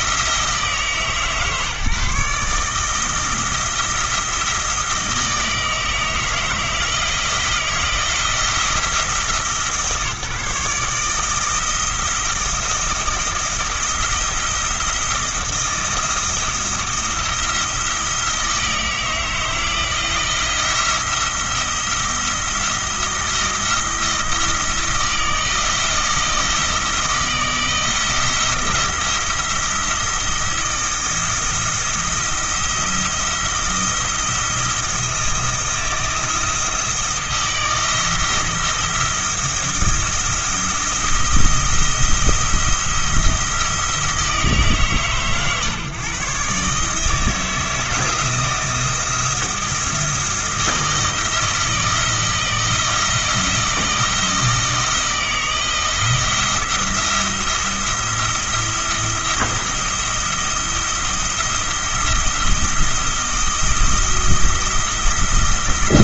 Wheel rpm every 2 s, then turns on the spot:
150, 160, 160, 160, 160, 150, 170, 170, 170, 160, 170, 170, 160, 160, 170, 170, 170, 170, 160, 170, 170, 170, 160, 150, 170, 170, 170, 160, 170, 170, 170, 170, 170.
none